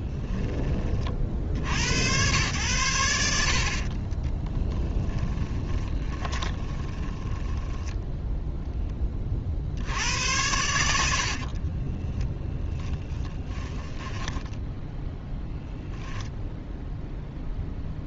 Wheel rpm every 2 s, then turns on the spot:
20, 100, 10, 20, 0, 90, 10, 0, 0.
4-8